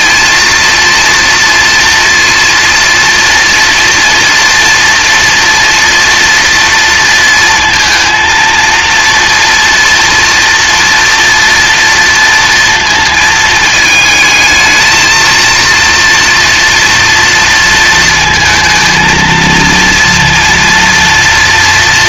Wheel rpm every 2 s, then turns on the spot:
230, 230, 230, 230, 230, 230, 230, 220, 230, 230, 230.
none